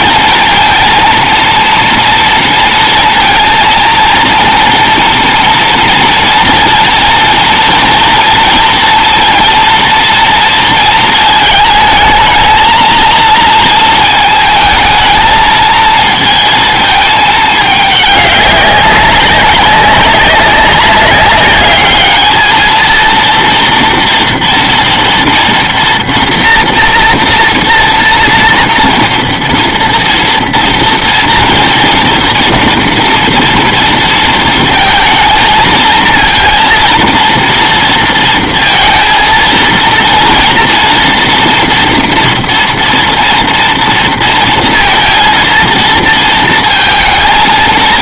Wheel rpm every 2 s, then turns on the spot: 230, 230, 230, 230, 230, 230, 220, 220, 220, 200, 190, 220, 230, 230, 230, 230, 230, 230, 230, 230, 230, 230, 230, 230.
none